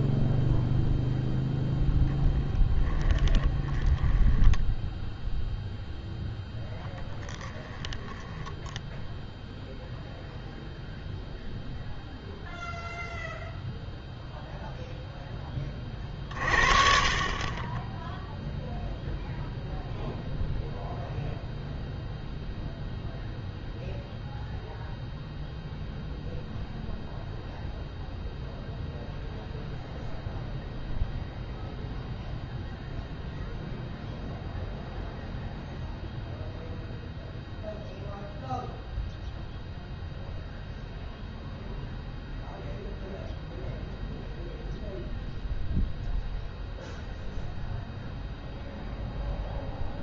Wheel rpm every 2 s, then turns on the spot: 0, 20, 10, 10, 10, 0, 0, 0, 40, 0, 0, 0, 0, 0, 0, 0, 0, 0, 0, 0, 0, 0, 0, 0, 0.
2-10